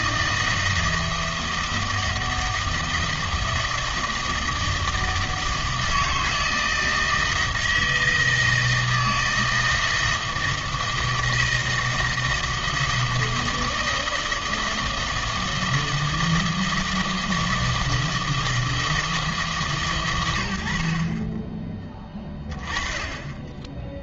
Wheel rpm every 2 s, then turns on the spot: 160, 160, 160, 160, 160, 160, 160, 160, 160, 160, 70, 20.
none